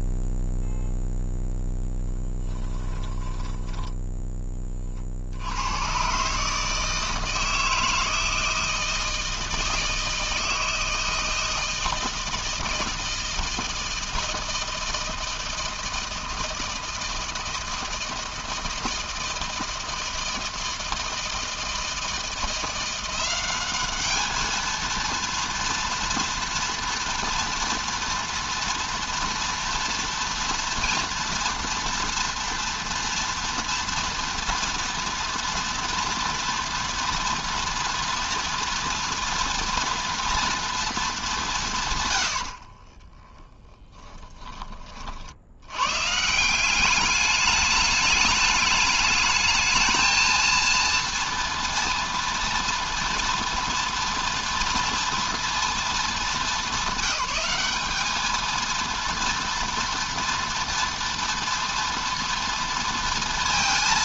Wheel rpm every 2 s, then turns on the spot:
0, 10, 60, 160, 160, 160, 160, 160, 160, 160, 160, 180, 230, 230, 230, 240, 230, 230, 230, 240, 210, 20, 50, 200, 220, 230, 230, 240, 200, 230, 230, 230.
2-4 42-44